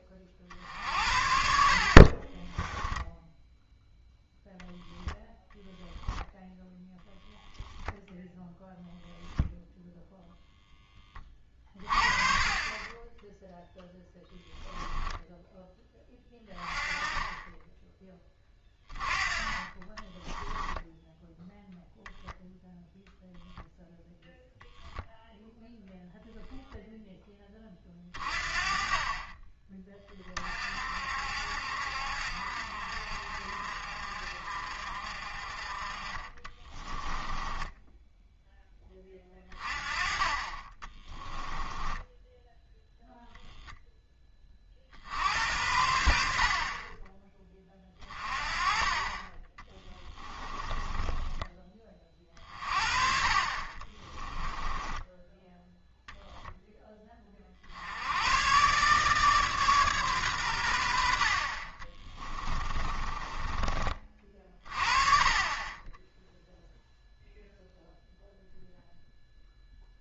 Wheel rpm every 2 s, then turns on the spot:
60, 10, 10, 0, 0, 10, 20, 0, 20, 20, 10, 0, 0, 0, 30, 50, 60, 50, 20, 10, 20, 0, 50, 30, 30, 10, 40, 10, 10, 140, 80, 20, 30, 0, 0.
20-22 36-38 50-52 54-56 62-64